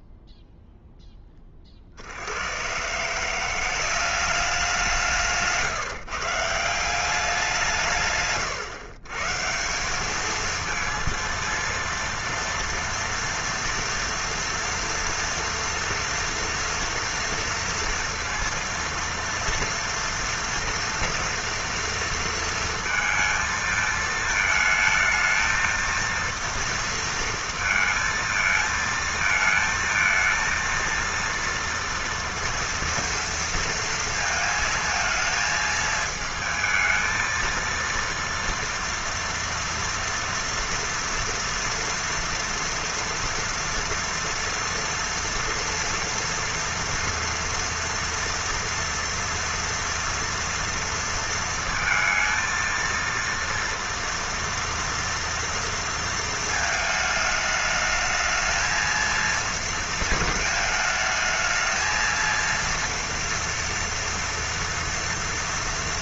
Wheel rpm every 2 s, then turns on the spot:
0, 80, 200, 130, 120, 220, 230, 240, 230, 230, 230, 230, 220, 230, 230, 230, 230, 230, 220, 230, 230, 230, 230, 230, 230, 230, 230, 230, 230, 220, 220, 230, 230.
none